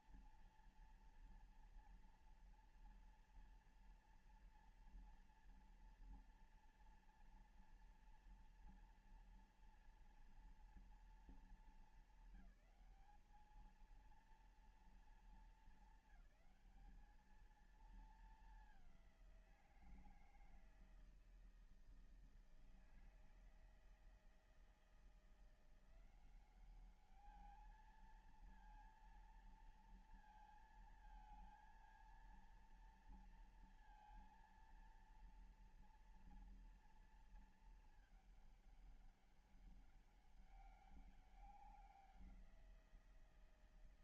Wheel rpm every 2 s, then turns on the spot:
230, 230, 230, 240, 240, 230, 220, 230, 200, 200, 160, 160, 170, 200, 230, 230, 230, 230, 230, 200, 200, 170.
none